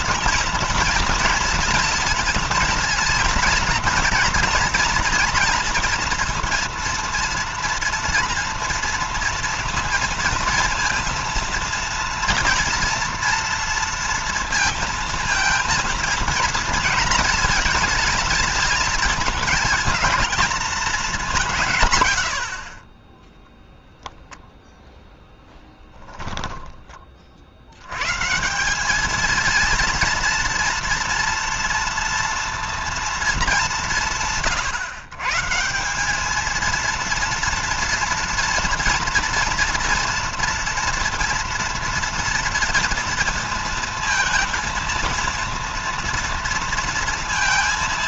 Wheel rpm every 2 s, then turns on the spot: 230, 230, 230, 230, 230, 230, 230, 220, 220, 220, 210, 30, 0, 30, 200, 230, 230, 140, 230, 230, 230, 230, 230, 230.
none